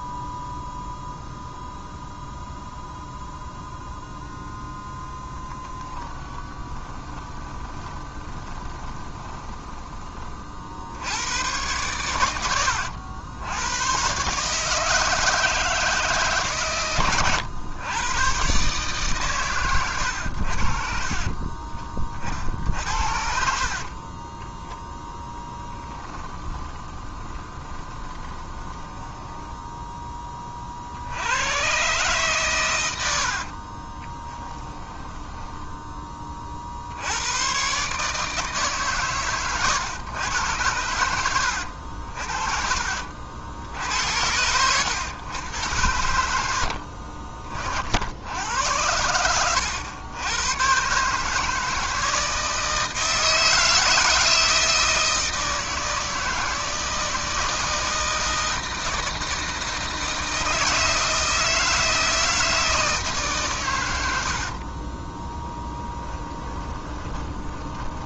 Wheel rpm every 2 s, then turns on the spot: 0, 0, 0, 30, 20, 70, 90, 160, 110, 140, 40, 60, 20, 20, 10, 70, 100, 10, 70, 130, 90, 70, 110, 60, 90, 140, 160, 160, 160, 160, 160, 160, 20, 20.
6-10 22-30 34-36 46-48 64-68